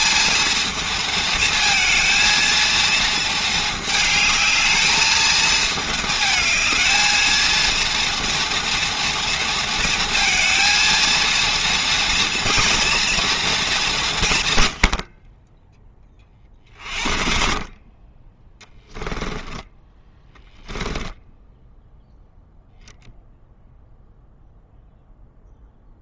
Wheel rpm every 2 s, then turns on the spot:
230, 230, 220, 220, 230, 230, 230, 80, 40, 10, 0, 0, 0.
18-20